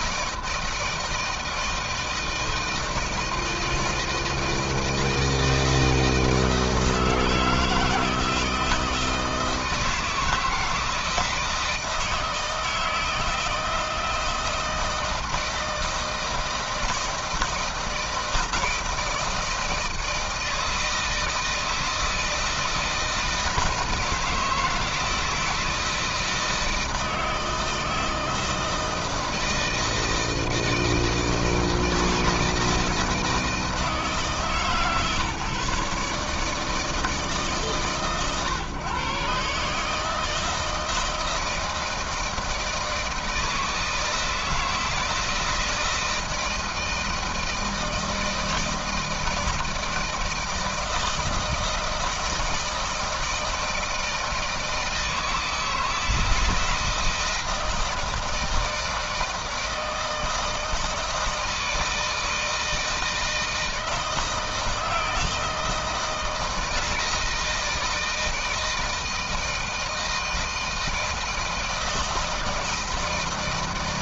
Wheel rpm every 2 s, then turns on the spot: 160, 160, 160, 160, 160, 160, 160, 170, 160, 160, 160, 160, 160, 160, 160, 160, 160, 150, 150, 140, 160, 160, 160, 160, 160, 160, 160, 160, 160, 160, 160, 160, 160, 160, 160, 160, 160.
none